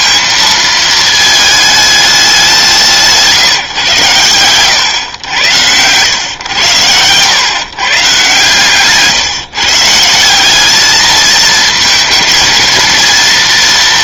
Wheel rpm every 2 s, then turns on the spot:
220, 140, 110, 140, 150, 220, 230.
none